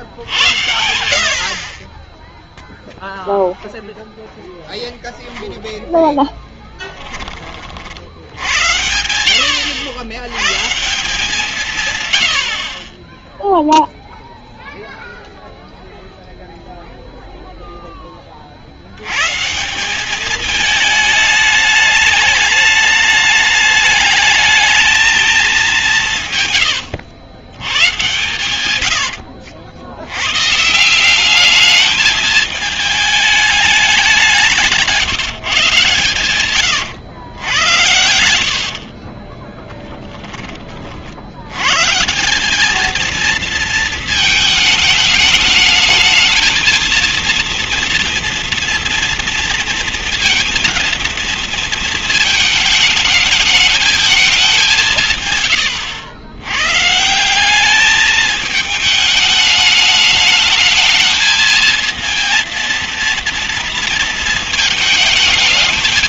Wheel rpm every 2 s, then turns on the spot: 70, 0, 10, 10, 90, 140, 90, 0, 0, 70, 210, 210, 220, 110, 120, 130, 220, 170, 120, 70, 20, 180, 220, 230, 230, 240, 220, 190, 120, 220, 210, 230, 230.
4-6 26-30 34-40